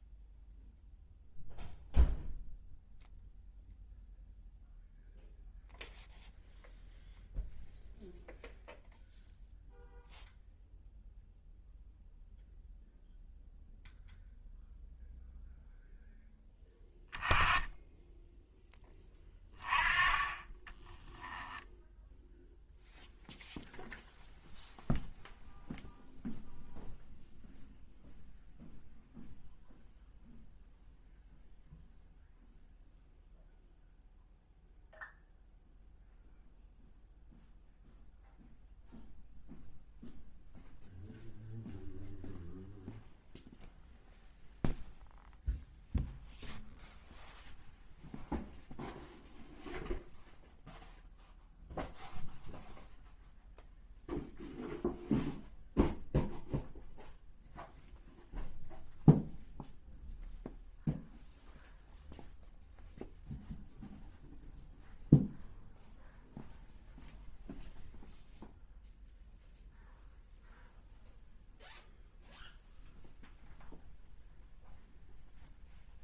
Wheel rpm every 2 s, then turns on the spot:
0, 0, 0, 0, 0, 0, 0, 0, 20, 10, 30, 0, 0, 0, 0, 0, 0, 0, 0, 0, 0, 0, 0, 0, 0, 0, 0, 0, 0, 0, 0, 0, 0, 0, 0, 0, 0, 0.
20-22